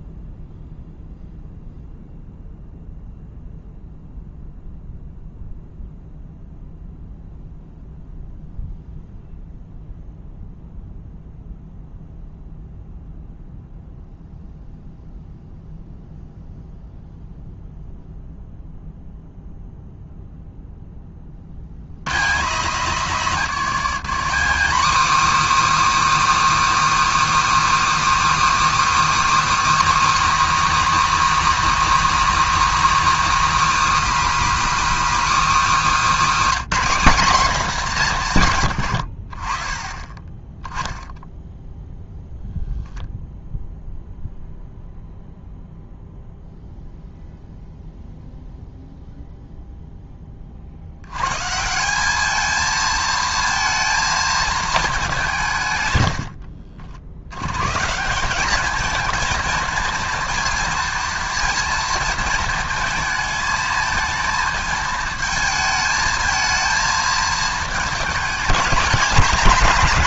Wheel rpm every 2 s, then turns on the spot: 0, 0, 0, 0, 0, 0, 0, 0, 0, 0, 0, 140, 270, 330, 330, 300, 300, 310, 270, 130, 10, 0, 0, 0, 0, 60, 220, 220, 60, 210, 230, 220, 220, 220, 200.
56-58